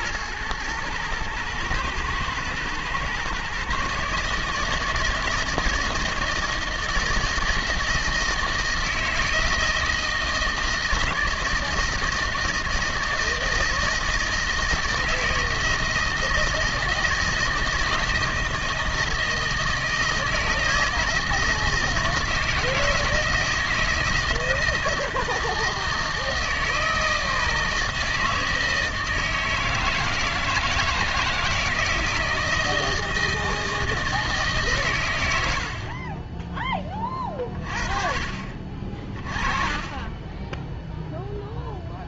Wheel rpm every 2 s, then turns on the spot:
120, 120, 150, 160, 160, 160, 160, 160, 160, 160, 160, 160, 160, 160, 160, 160, 160, 150, 20, 40, 20.
none